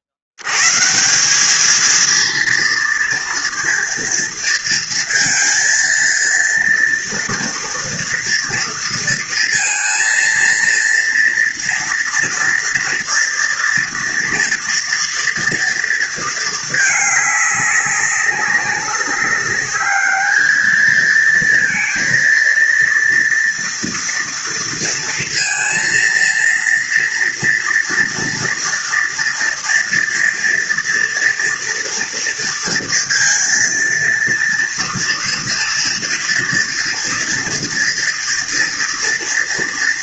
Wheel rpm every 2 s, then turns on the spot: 80, 230, 230, 230, 230, 230, 230, 240, 220, 190, 220, 230, 230, 230, 230, 230, 230, 230, 230, 230.
none